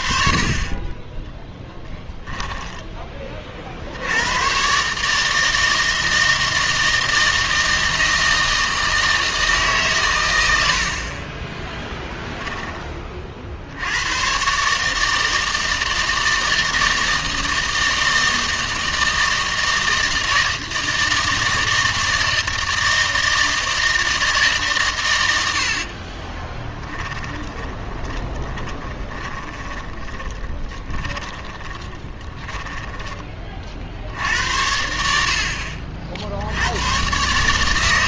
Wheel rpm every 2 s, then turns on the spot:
30, 10, 120, 160, 160, 90, 10, 140, 160, 160, 160, 160, 140, 10, 20, 20, 20, 80, 90.
2-4 26-34